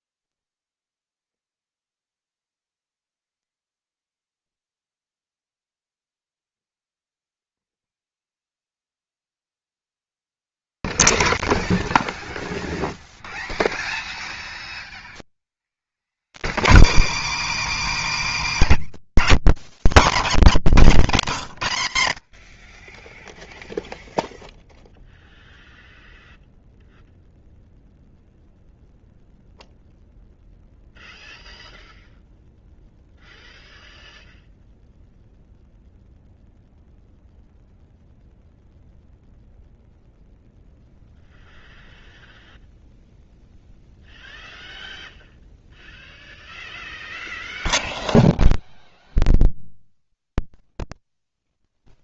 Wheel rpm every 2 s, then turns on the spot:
0, 0, 0, 0, 0, 0, 0, 0, 130, 320, 260, 60, 0, 0, 0, 0, 0, 0, 0, 0, 0, 0, 0, 0, 0, 0.
none